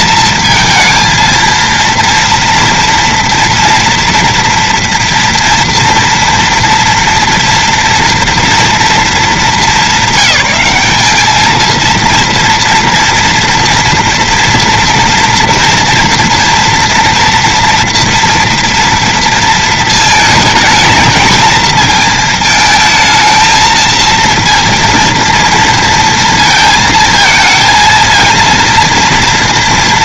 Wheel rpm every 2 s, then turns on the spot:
230, 230, 230, 230, 230, 200, 230, 230, 240, 230, 220, 220, 230, 220, 230.
none